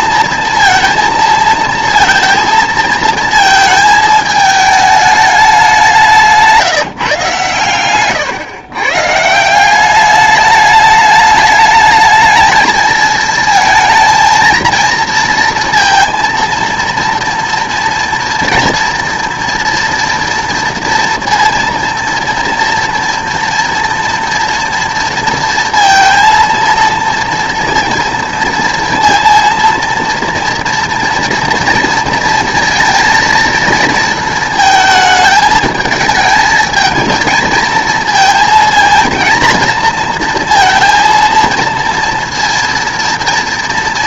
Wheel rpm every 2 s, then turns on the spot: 230, 230, 220, 160, 130, 210, 220, 230, 230, 230, 230, 230, 240, 230, 230, 230, 230, 220, 230, 230, 230, 230.
none